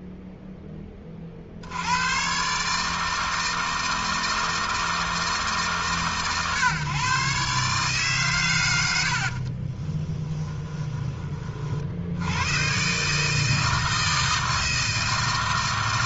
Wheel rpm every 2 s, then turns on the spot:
40, 150, 160, 130, 90, 20, 140, 160.
none